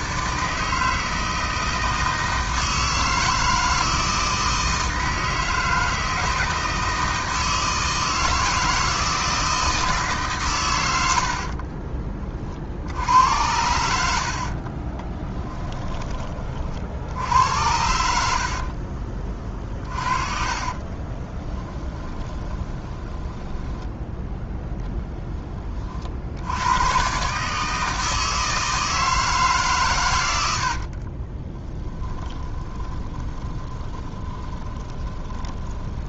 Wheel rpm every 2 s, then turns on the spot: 160, 160, 160, 160, 160, 100, 70, 30, 50, 40, 30, 20, 10, 110, 160, 60, 20, 10.
14-16 20-24 30-36